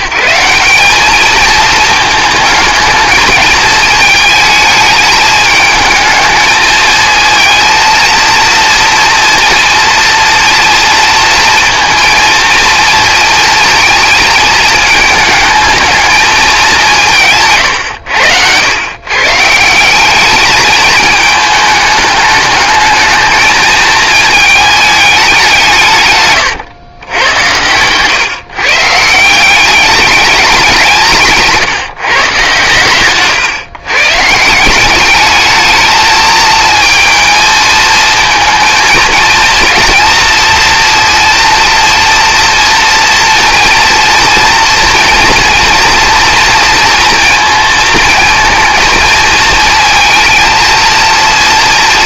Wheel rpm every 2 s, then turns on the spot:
210, 220, 220, 230, 230, 230, 230, 220, 170, 150, 220, 220, 200, 100, 170, 160, 130, 200, 230, 230, 240, 230, 230, 230, 220, 230.
16-18